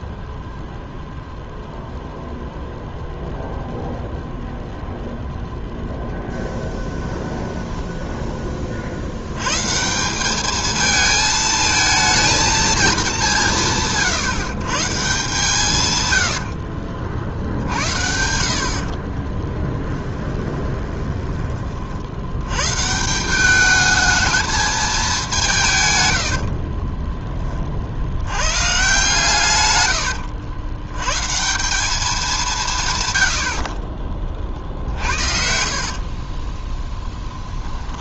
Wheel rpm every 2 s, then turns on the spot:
0, 0, 0, 10, 40, 220, 220, 130, 60, 50, 20, 120, 220, 40, 130, 100, 160, 50, 20.
6-8 16-22 26-28 36-38